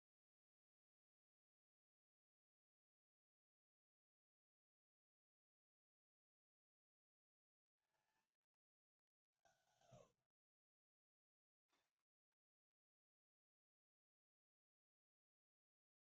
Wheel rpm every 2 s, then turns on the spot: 0, 0, 0, 0, 0, 0, 0, 0.
none